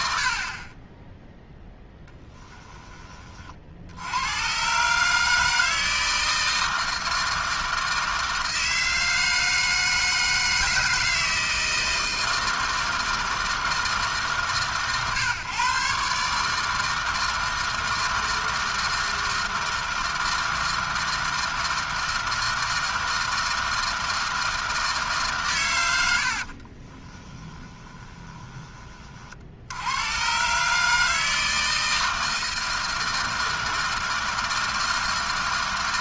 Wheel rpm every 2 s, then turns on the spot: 0, 40, 150, 160, 160, 160, 160, 130, 160, 160, 160, 160, 160, 30, 40, 150, 160, 160.
26-28